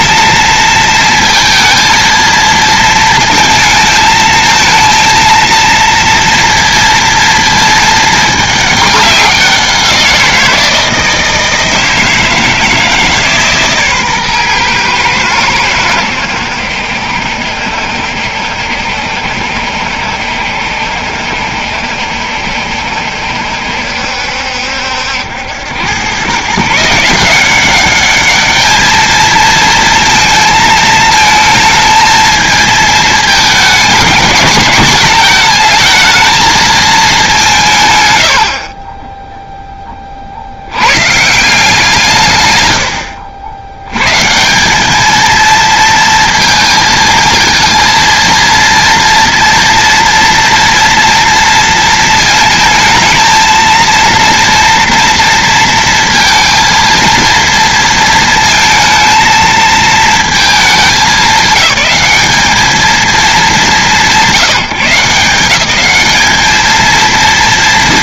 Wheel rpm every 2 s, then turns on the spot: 220, 230, 220, 230, 210, 170, 160, 110, 80, 70, 70, 70, 70, 150, 220, 220, 220, 220, 220, 30, 80, 100, 200, 220, 230, 230, 220, 230, 230, 220, 210, 200, 180, 220.
none